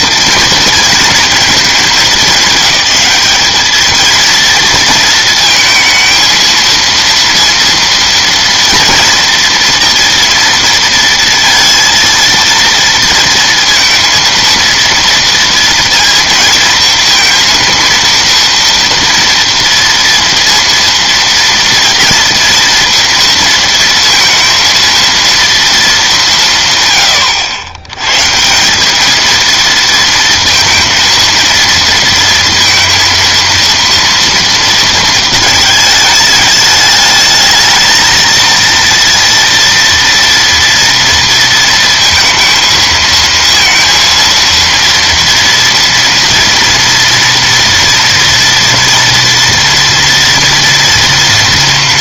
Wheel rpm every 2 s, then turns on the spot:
230, 210, 230, 230, 230, 230, 230, 230, 230, 230, 230, 230, 230, 130, 180, 230, 230, 230, 210, 230, 230, 220, 230, 230, 230, 230.
none